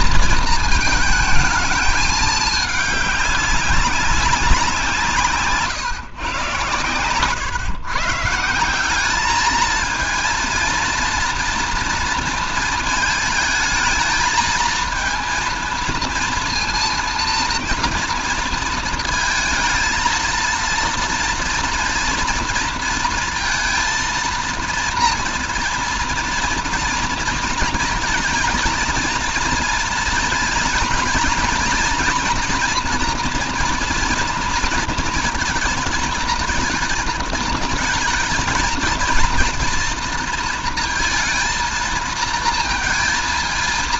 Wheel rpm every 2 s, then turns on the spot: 220, 210, 180, 120, 160, 230, 230, 230, 230, 230, 230, 230, 230, 230, 230, 220, 240, 230, 230, 220, 230, 230.
none